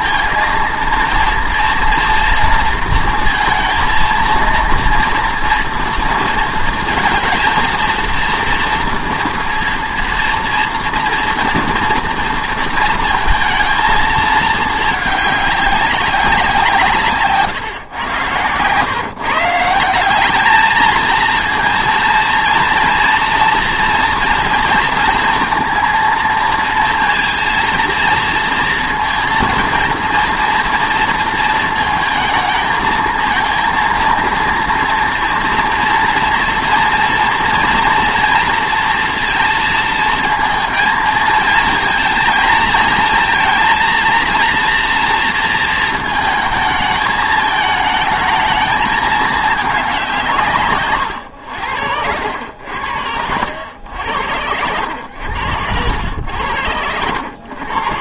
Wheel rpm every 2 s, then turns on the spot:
230, 230, 230, 230, 230, 230, 230, 210, 160, 120, 220, 230, 230, 230, 230, 230, 220, 230, 240, 230, 220, 220, 230, 220, 220, 130, 80, 90, 90.
50-52 54-56